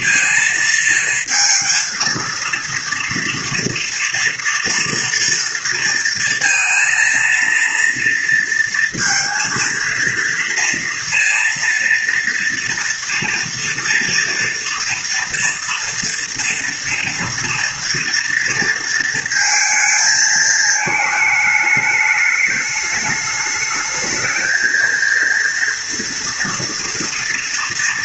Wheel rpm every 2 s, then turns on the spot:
230, 230, 230, 230, 230, 230, 230, 230, 230, 230, 220, 210, 220, 230.
none